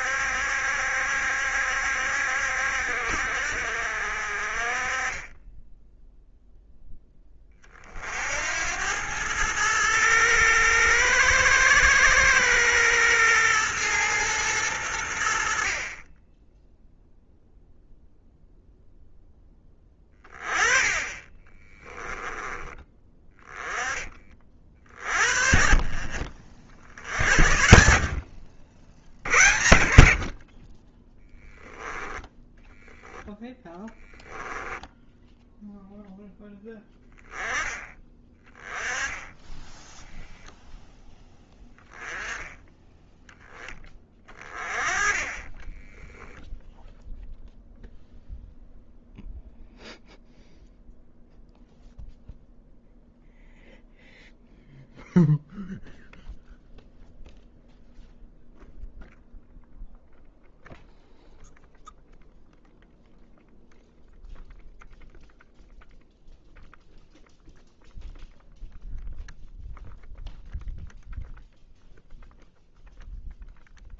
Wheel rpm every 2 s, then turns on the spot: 70, 60, 30, 10, 90, 110, 120, 100, 0, 0, 20, 20, 40, 50, 70, 20, 10, 10, 10, 10, 0, 10, 30, 0, 0, 0, 0, 0, 0, 0, 0, 0, 0, 0, 0, 0, 0.
32-36 44-46